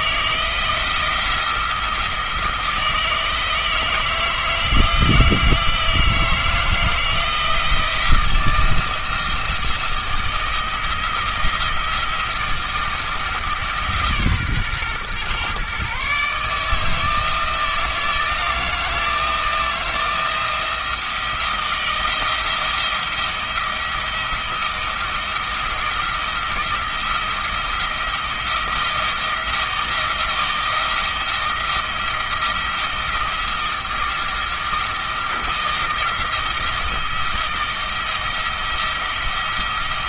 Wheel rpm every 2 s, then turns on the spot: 170, 170, 160, 160, 170, 160, 170, 130, 150, 160, 170, 170, 170, 170, 160, 170, 170, 170, 170, 170.
none